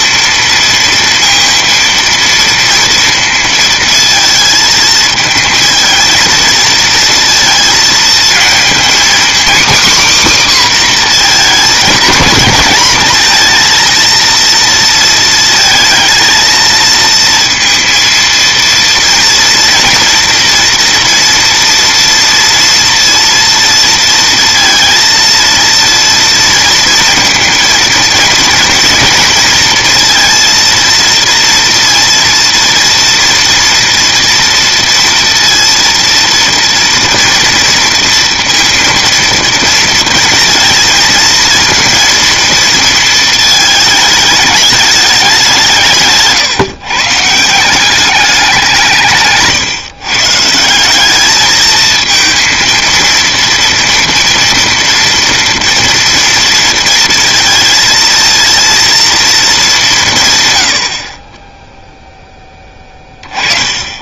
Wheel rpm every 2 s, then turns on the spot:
230, 230, 220, 230, 230, 270, 230, 230, 220, 230, 240, 230, 230, 230, 230, 230, 230, 230, 230, 230, 220, 230, 210, 140, 180, 170, 230, 230, 230, 230, 110, 10.
none